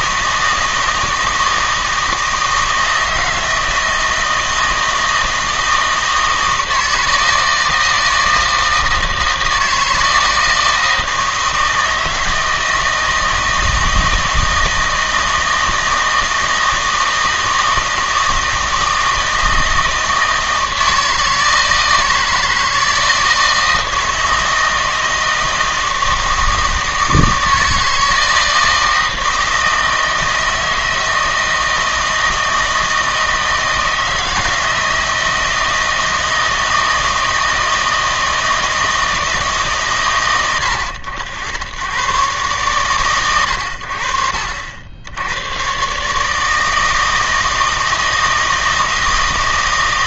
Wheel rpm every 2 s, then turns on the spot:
160, 160, 160, 160, 160, 160, 160, 160, 160, 160, 160, 160, 160, 160, 160, 160, 160, 160, 160, 160, 90, 120, 70, 160, 160.
none